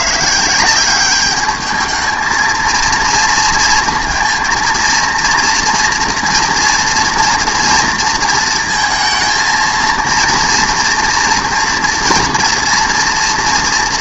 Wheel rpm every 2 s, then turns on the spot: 170, 230, 230, 230, 230, 230, 230.
none